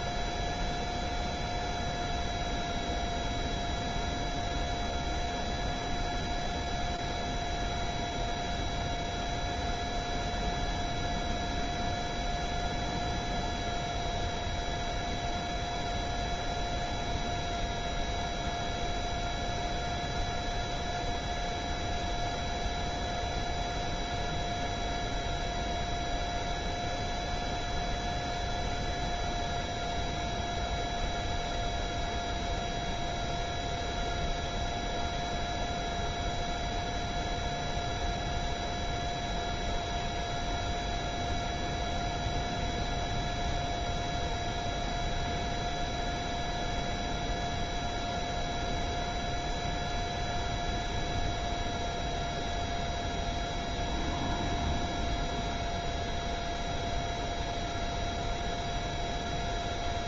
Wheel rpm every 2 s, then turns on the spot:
0, 0, 0, 0, 0, 0, 0, 0, 0, 0, 0, 0, 0, 0, 0, 0, 0, 0, 0, 0, 0, 0, 0, 0, 0, 0, 0, 0, 0, 0.
none